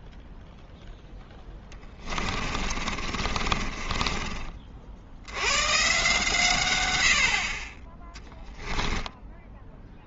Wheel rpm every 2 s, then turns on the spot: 0, 30, 50, 110, 10.
2-4 8-10